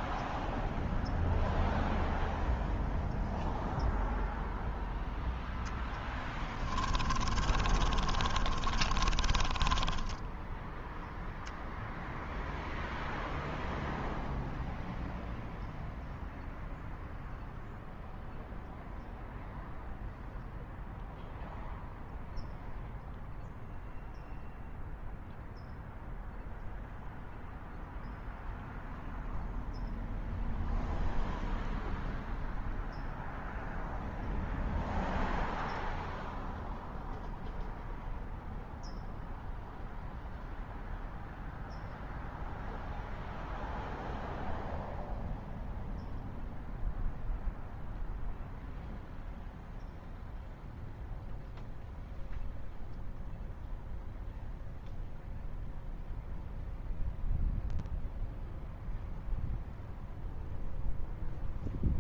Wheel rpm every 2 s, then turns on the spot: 0, 0, 0, 10, 30, 10, 0, 0, 0, 0, 0, 0, 0, 0, 0, 0, 0, 0, 0, 0, 0, 0, 0, 0, 0, 0, 0, 0, 0, 0, 0.
6-12